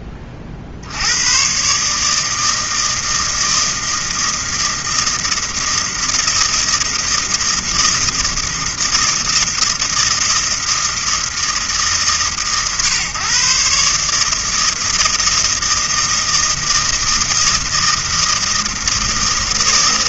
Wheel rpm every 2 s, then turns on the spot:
50, 160, 160, 160, 160, 160, 130, 160, 160, 160.
none